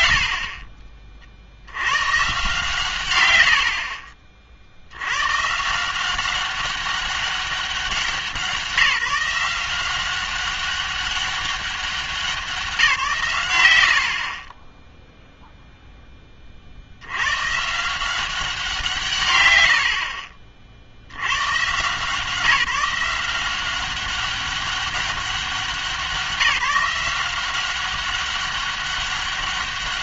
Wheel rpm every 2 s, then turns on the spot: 70, 130, 60, 200, 180, 190, 190, 40, 40, 180, 50, 170, 200, 180, 200.
14-16